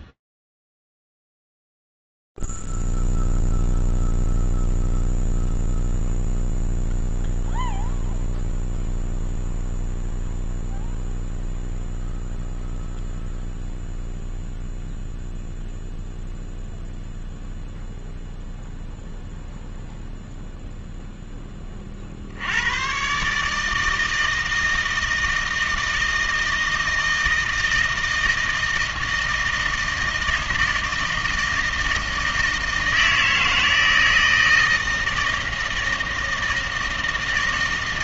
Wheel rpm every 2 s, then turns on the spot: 0, 0, 0, 0, 0, 0, 0, 0, 0, 0, 0, 100, 160, 160, 160, 160, 160, 160, 160.
none